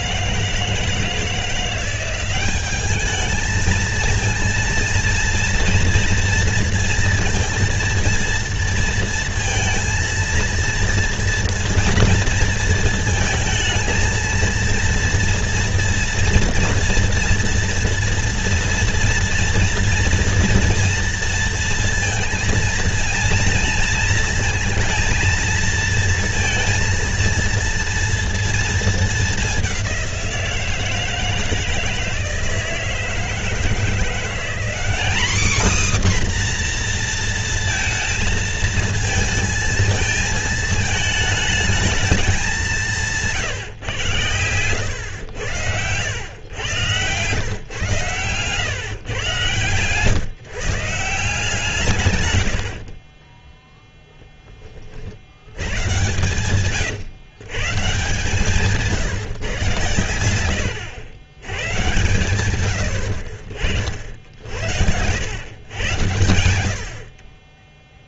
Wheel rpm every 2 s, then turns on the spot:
160, 200, 230, 230, 230, 230, 230, 230, 230, 230, 230, 230, 230, 230, 230, 170, 160, 200, 260, 220, 220, 190, 110, 120, 140, 150, 90, 20, 130, 160, 100, 100, 70, 80.
44-46 56-58